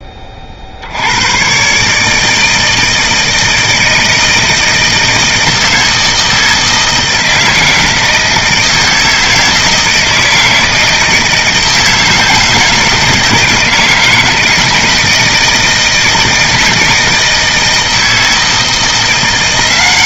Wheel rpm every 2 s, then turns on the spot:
50, 160, 160, 160, 160, 160, 160, 160, 160, 160.
none